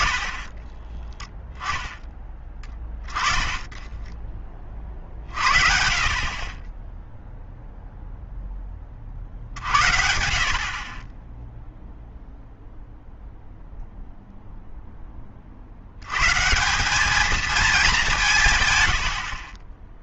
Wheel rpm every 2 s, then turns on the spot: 10, 20, 40, 20, 20, 30, 0, 0, 170, 120.
0-4